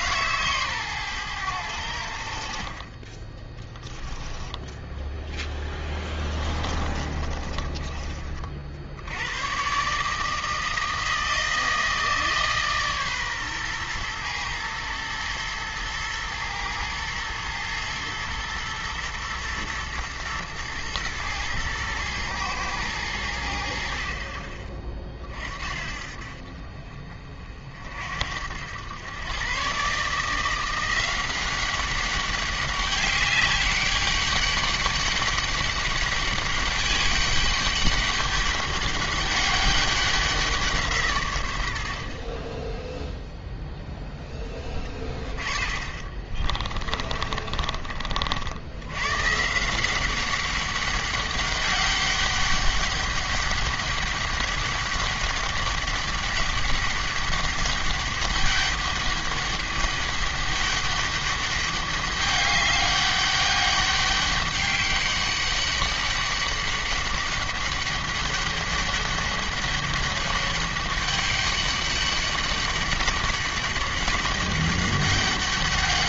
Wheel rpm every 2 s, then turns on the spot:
140, 40, 10, 20, 60, 160, 150, 110, 110, 110, 120, 110, 30, 50, 90, 170, 200, 200, 200, 200, 170, 10, 20, 40, 80, 200, 200, 200, 200, 200, 200, 200, 200, 200, 200, 200, 200, 200.
4-8 46-48